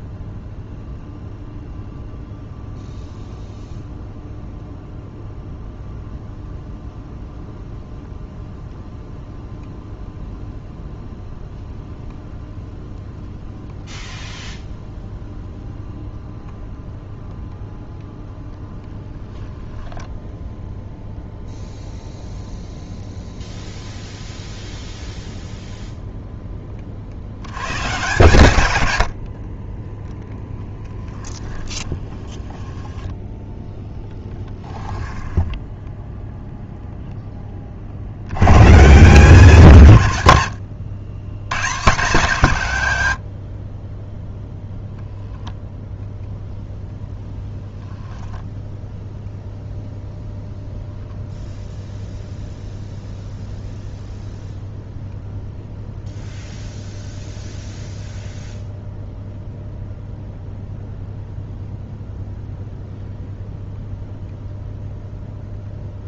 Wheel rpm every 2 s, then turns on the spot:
0, 0, 0, 0, 0, 0, 0, 0, 0, 0, 0, 0, 0, 30, 90, 10, 10, 20, 0, 140, 100, 120, 0, 0, 0, 0, 0, 0, 0, 0, 0, 0, 0.
30-36